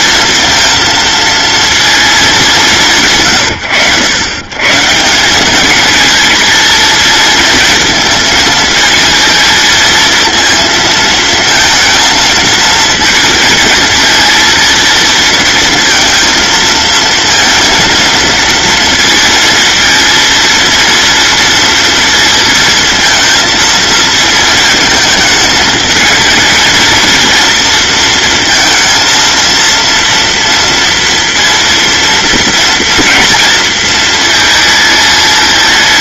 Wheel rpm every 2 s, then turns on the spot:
230, 160, 160, 230, 220, 230, 230, 230, 230, 230, 230, 230, 220, 230, 230, 230, 230, 220.
none